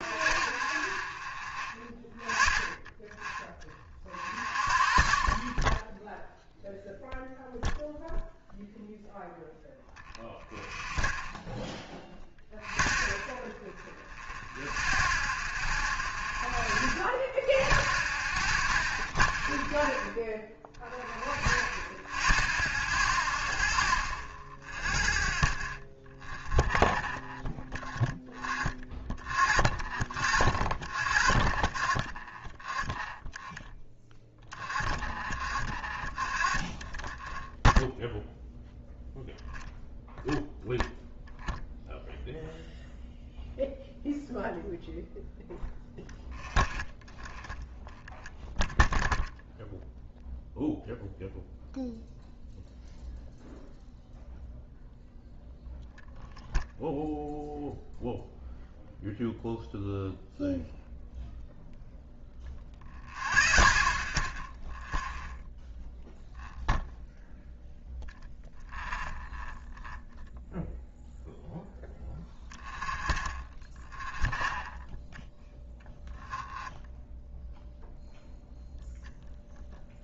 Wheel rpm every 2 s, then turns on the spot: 0, 0, 0, 0, 0, 0, 0, 0, 0, 0, 0, 0, 0, 0, 0, 0, 0, 0, 0, 0, 0, 0, 0, 0, 0, 0, 0, 0, 0, 0, 0, 0, 0, 0, 0, 0, 0, 0, 0, 0.
none